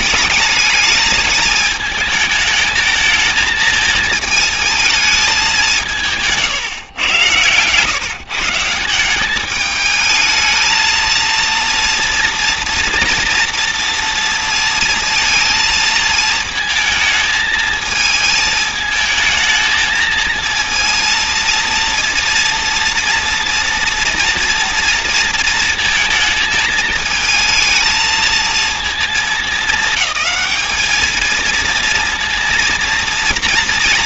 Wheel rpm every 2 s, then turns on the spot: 210, 220, 220, 140, 160, 230, 230, 230, 220, 220, 230, 230, 230, 220, 220, 220, 230.
none